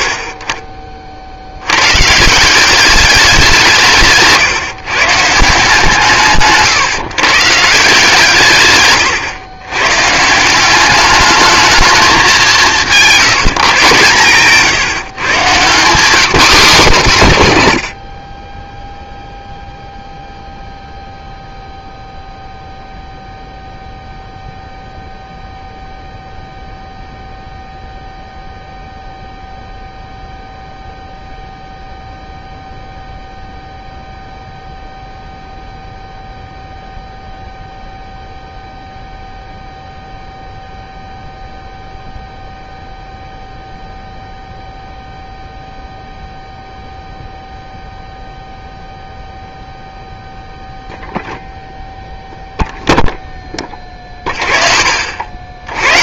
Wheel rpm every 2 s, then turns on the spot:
50, 180, 140, 140, 140, 190, 190, 140, 200, 10, 0, 0, 0, 0, 0, 0, 0, 0, 0, 0, 0, 0, 0, 0, 0, 0, 0, 50.
none